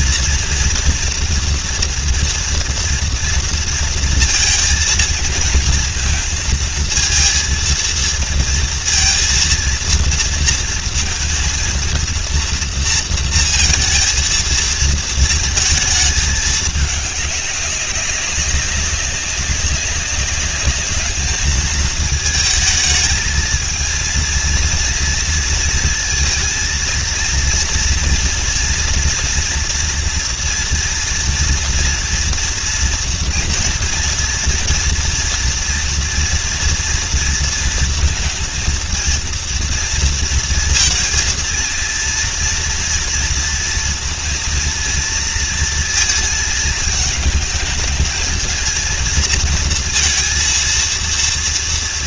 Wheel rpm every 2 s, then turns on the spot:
230, 230, 220, 230, 230, 230, 230, 220, 210, 190, 210, 220, 230, 230, 230, 230, 230, 230, 230, 230, 220, 230, 230, 220, 220, 230.
none